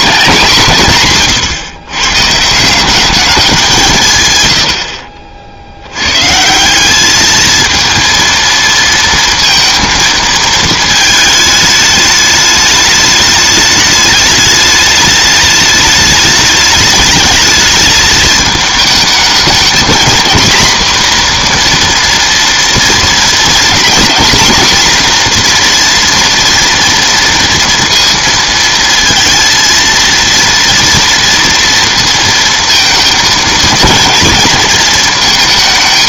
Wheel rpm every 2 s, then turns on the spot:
150, 170, 80, 180, 230, 220, 210, 210, 210, 220, 240, 230, 240, 240, 230, 230, 230, 220.
none